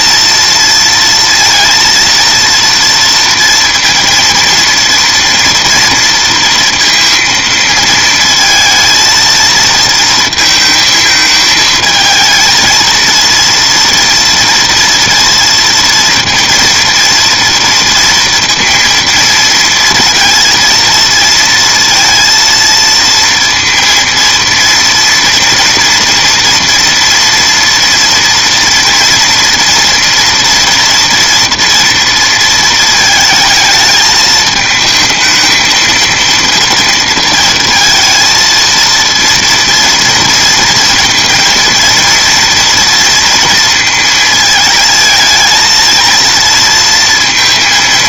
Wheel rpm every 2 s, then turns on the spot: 230, 230, 230, 230, 230, 220, 230, 230, 230, 230, 230, 230, 230, 230, 230, 230, 220, 220, 230, 230, 230, 230, 220, 230.
none